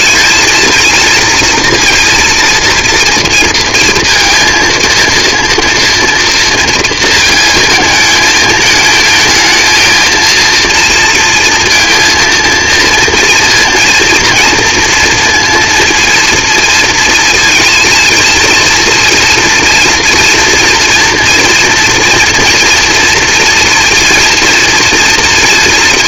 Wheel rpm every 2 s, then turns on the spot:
230, 230, 230, 230, 220, 230, 230, 230, 230, 230, 230, 230, 230.
none